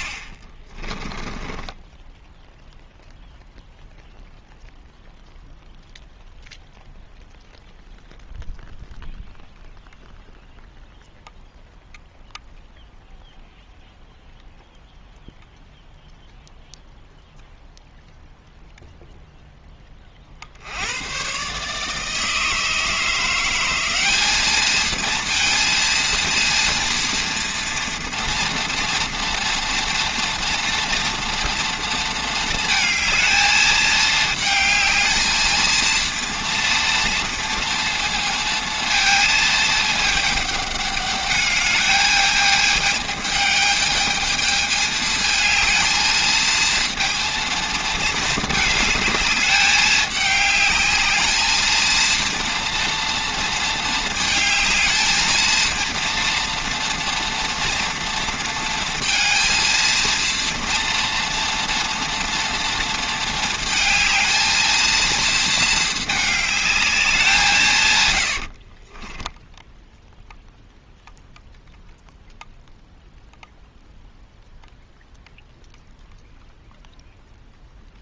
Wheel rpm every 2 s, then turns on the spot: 30, 0, 0, 0, 0, 0, 0, 0, 0, 0, 80, 160, 220, 230, 230, 230, 220, 220, 230, 230, 210, 220, 220, 230, 220, 210, 230, 220, 230, 230, 230, 230, 220, 210, 40, 0, 0, 0, 0.
0-2 68-70